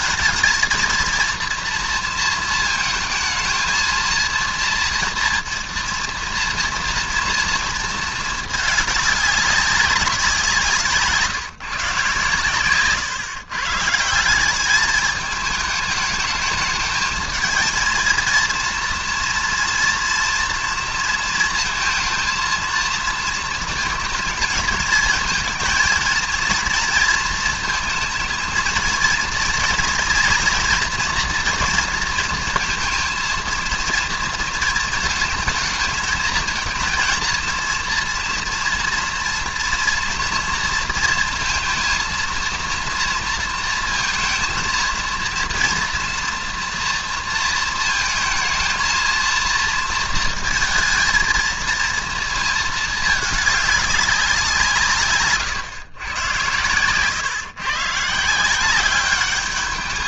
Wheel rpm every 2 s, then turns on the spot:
230, 230, 230, 230, 210, 170, 130, 200, 210, 230, 230, 230, 220, 230, 230, 230, 230, 230, 220, 230, 230, 230, 230, 230, 230, 230, 220, 170, 120, 180.
none